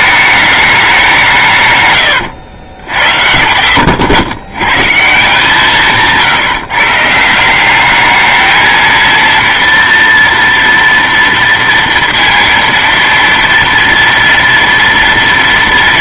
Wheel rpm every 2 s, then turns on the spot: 210, 90, 120, 150, 220, 230, 230, 230.
2-4